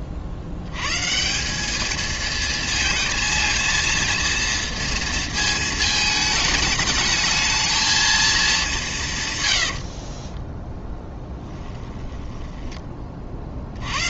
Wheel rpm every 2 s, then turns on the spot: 90, 220, 230, 220, 210, 10, 10.
10-12